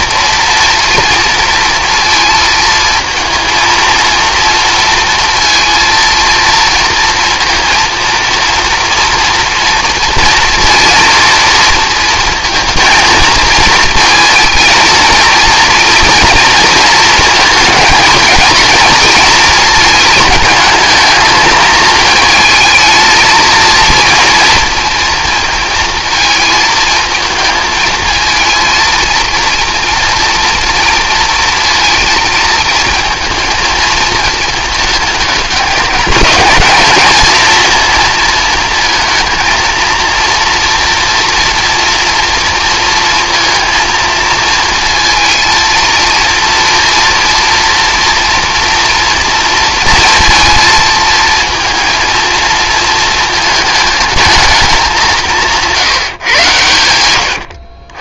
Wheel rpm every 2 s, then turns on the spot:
240, 230, 230, 230, 230, 240, 230, 230, 230, 220, 220, 220, 240, 220, 230, 230, 230, 220, 220, 230, 240, 230, 230, 230, 230, 230, 230, 210, 120.
none